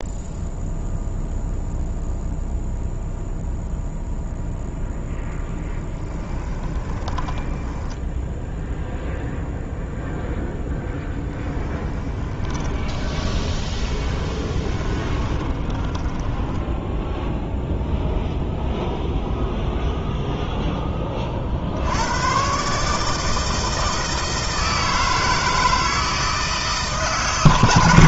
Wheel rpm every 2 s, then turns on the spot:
0, 0, 0, 20, 0, 10, 20, 20, 0, 0, 20, 150, 160, 150.
6-8 10-16